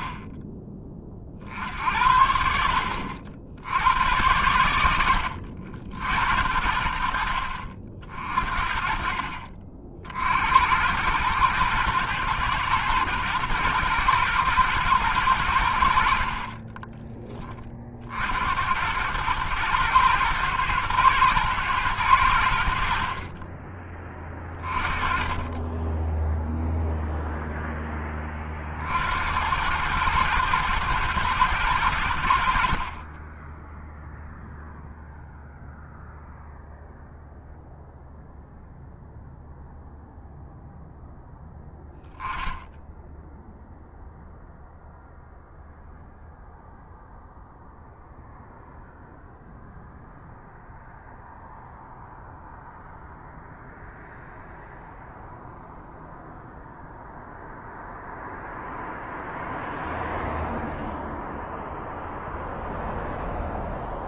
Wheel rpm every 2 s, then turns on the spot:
30, 60, 100, 70, 50, 70, 120, 120, 50, 60, 120, 90, 20, 10, 30, 110, 80, 0, 0, 0, 0, 10, 0, 0, 0, 0, 0, 0, 0, 0, 0, 0.
none